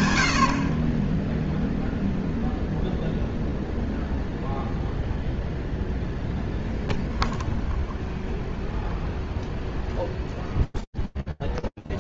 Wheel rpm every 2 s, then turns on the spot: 20, 0, 0, 0, 0, 0.
none